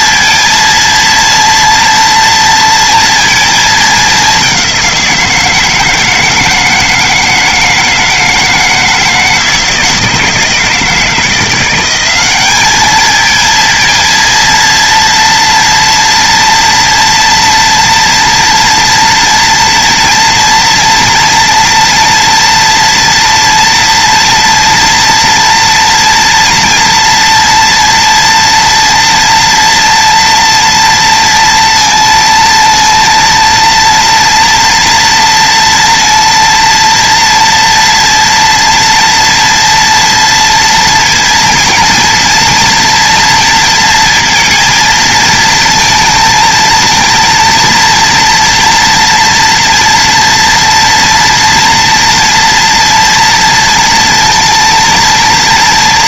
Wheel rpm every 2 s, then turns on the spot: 230, 230, 180, 160, 160, 170, 220, 230, 230, 240, 230, 230, 230, 230, 230, 230, 230, 230, 230, 230, 230, 230, 230, 230, 240, 230, 240, 230.
none